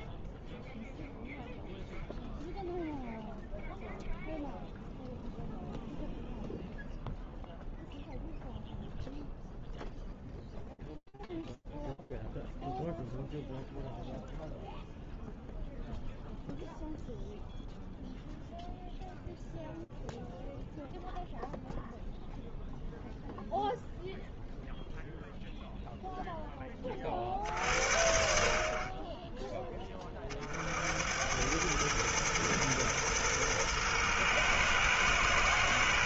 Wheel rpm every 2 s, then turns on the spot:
0, 0, 0, 0, 0, 0, 0, 0, 0, 0, 0, 0, 0, 60, 20, 100, 120, 120.
none